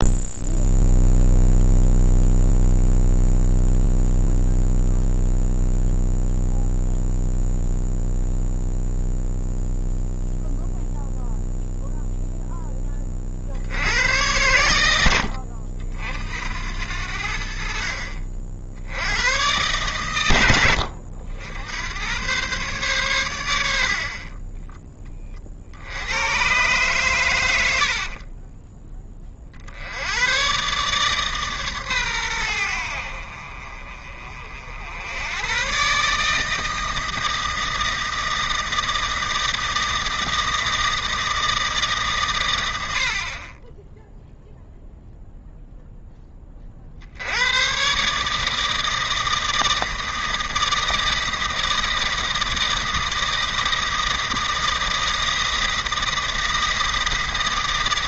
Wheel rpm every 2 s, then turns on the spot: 0, 0, 0, 0, 0, 0, 10, 100, 70, 70, 90, 120, 10, 120, 10, 130, 80, 70, 160, 160, 160, 90, 0, 50, 160, 160, 160, 160, 160.
none